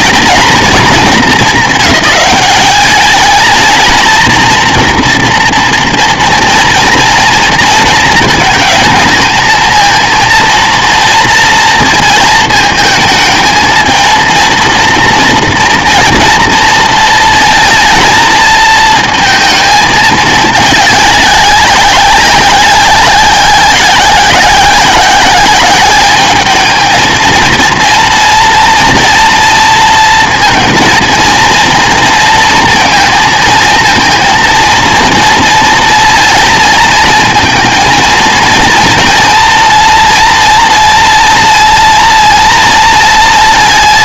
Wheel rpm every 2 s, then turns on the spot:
230, 200, 230, 230, 220, 230, 220, 230, 230, 220, 210, 190, 190, 220, 230, 230, 230, 230, 230, 230, 230, 230.
none